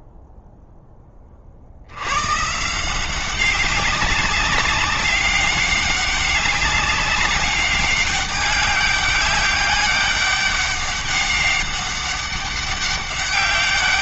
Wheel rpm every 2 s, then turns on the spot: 10, 170, 200, 190, 200, 200, 190.
none